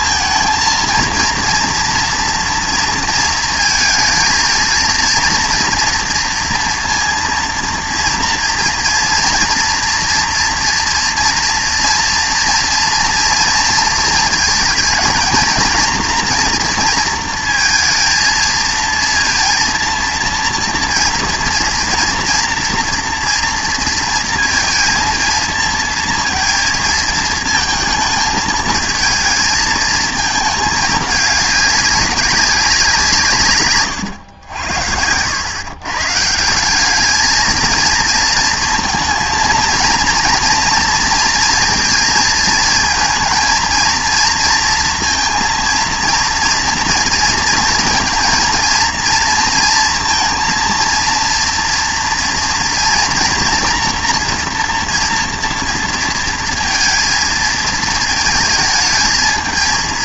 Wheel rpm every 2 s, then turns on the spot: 230, 230, 230, 240, 230, 240, 230, 230, 230, 230, 230, 240, 230, 220, 220, 210, 180, 90, 200, 230, 230, 230, 230, 230, 230, 230, 230, 240, 230, 220.
none